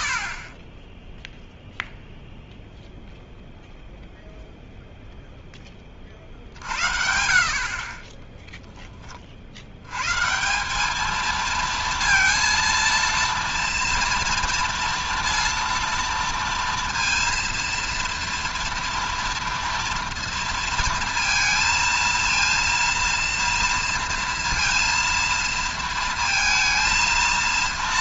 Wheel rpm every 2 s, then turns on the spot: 20, 0, 0, 60, 10, 180, 230, 230, 230, 230, 230, 230, 230, 230.
none